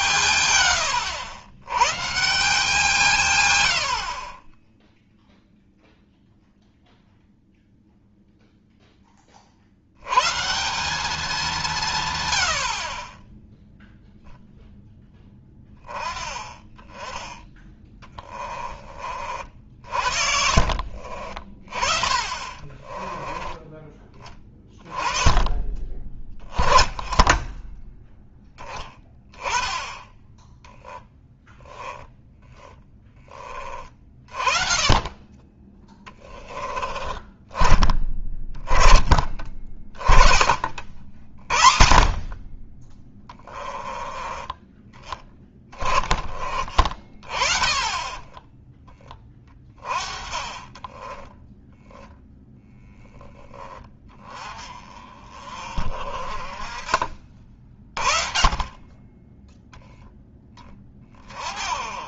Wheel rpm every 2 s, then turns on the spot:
110, 160, 20, 0, 0, 170, 70, 0, 10, 30, 50, 30, 20, 10, 10, 10, 10, 30, 20, 20, 50, 30, 20, 30, 10, 30, 0, 20, 30, 30, 10.
22-24 32-34 50-52